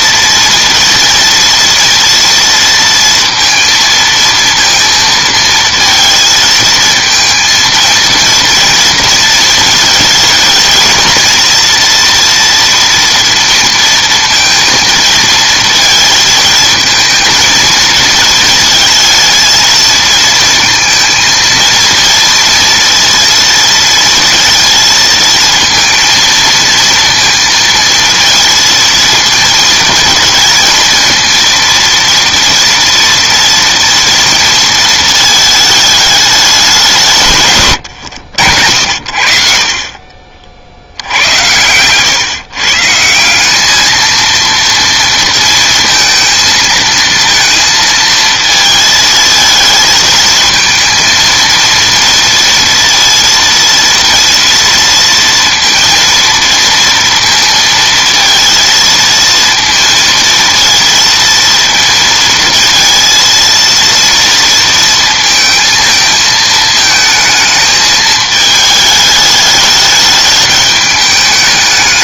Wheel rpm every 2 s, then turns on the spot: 230, 230, 230, 220, 230, 230, 230, 230, 220, 230, 230, 230, 230, 230, 230, 230, 230, 220, 160, 50, 80, 170, 230, 230, 220, 230, 230, 230, 230, 230, 230, 230, 230, 220, 210, 210.
38-40